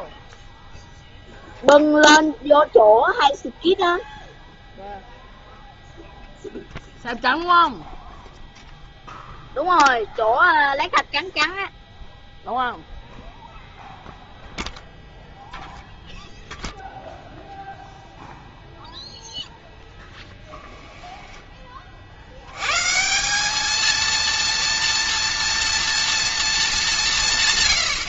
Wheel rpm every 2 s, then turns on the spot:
0, 0, 0, 0, 0, 0, 0, 0, 0, 0, 0, 110, 230, 220.
none